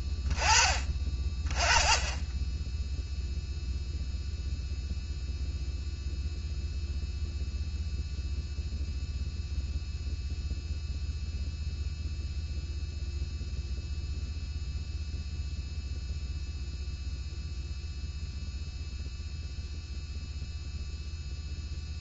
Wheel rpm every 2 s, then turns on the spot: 10, 10, 0, 0, 0, 0, 0, 0, 0, 0, 0.
none